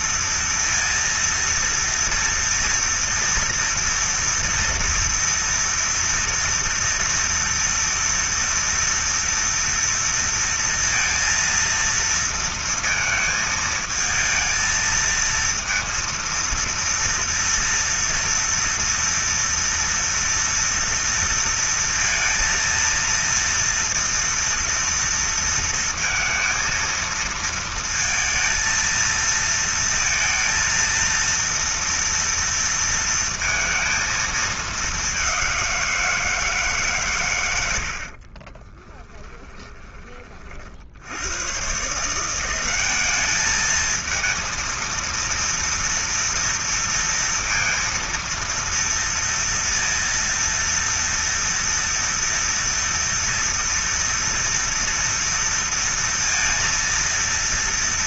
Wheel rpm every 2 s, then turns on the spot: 230, 230, 230, 230, 230, 230, 230, 220, 230, 230, 230, 230, 230, 230, 230, 230, 230, 210, 140, 20, 60, 190, 230, 230, 230, 230, 230, 230, 230.
38-40